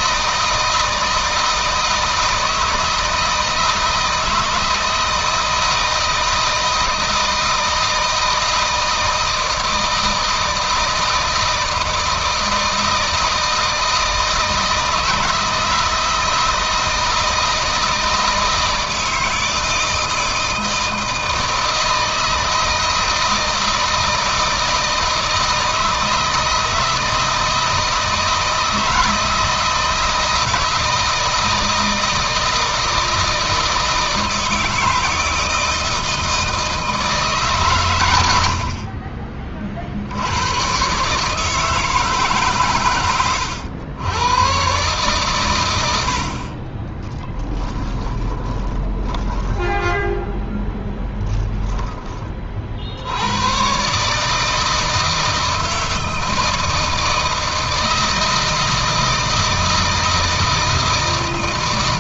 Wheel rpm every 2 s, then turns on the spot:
160, 160, 160, 160, 160, 160, 160, 160, 160, 160, 160, 160, 160, 160, 160, 160, 160, 160, 160, 60, 120, 140, 130, 30, 10, 10, 60, 160, 160, 160, 160.
46-52